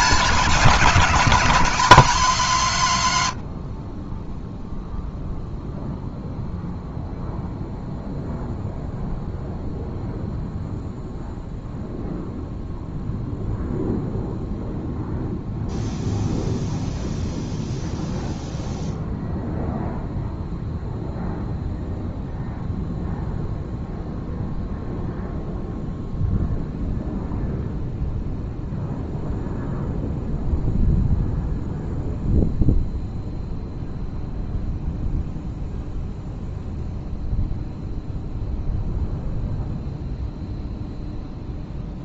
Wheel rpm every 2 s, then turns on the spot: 180, 150, 0, 0, 0, 0, 0, 0, 0, 0, 0, 0, 0, 0, 0, 0, 0, 0, 0, 0, 0.
none